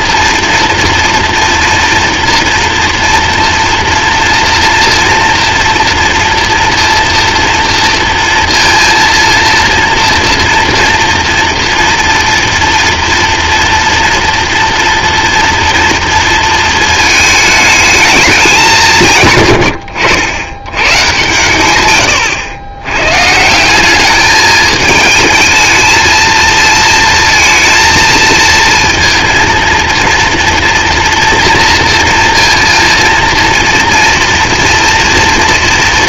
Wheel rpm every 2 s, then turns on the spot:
230, 230, 230, 240, 230, 230, 230, 230, 230, 190, 100, 100, 210, 220, 220, 230, 230, 230.
none